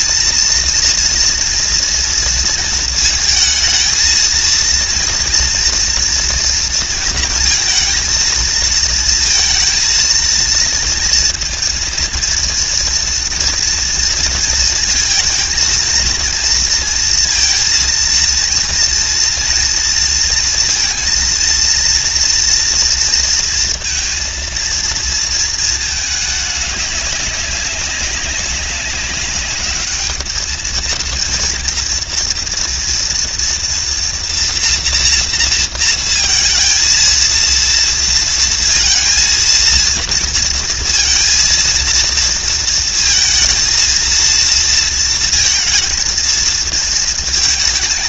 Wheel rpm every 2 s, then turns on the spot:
230, 220, 230, 230, 230, 230, 230, 220, 230, 230, 230, 230, 230, 200, 200, 220, 230, 230, 230, 230, 230, 230, 230, 230.
none